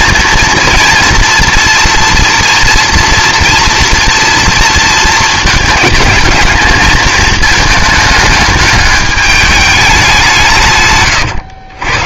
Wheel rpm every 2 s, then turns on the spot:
230, 230, 230, 220, 210, 150.
none